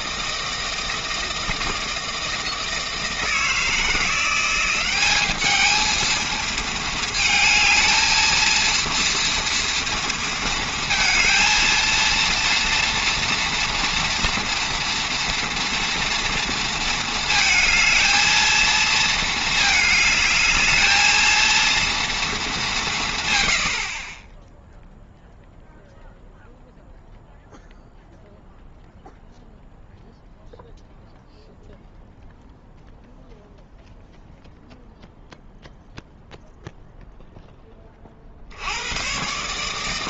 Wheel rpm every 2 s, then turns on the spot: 160, 160, 180, 220, 230, 230, 240, 230, 230, 220, 220, 200, 0, 0, 0, 0, 0, 0, 0, 70.
none